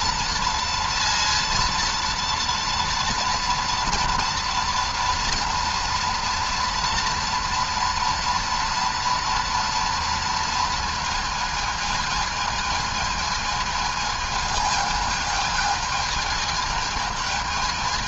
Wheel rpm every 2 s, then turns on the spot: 230, 230, 230, 230, 230, 230, 220, 220, 220.
none